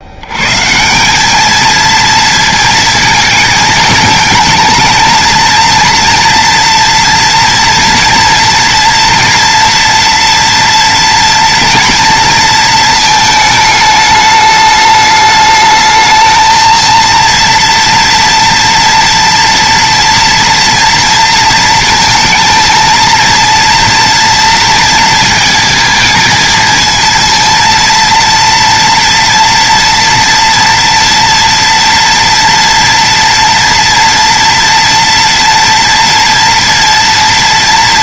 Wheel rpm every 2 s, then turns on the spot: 170, 230, 220, 230, 230, 240, 220, 210, 230, 240, 240, 230, 230, 230, 230, 230, 230, 230, 230.
none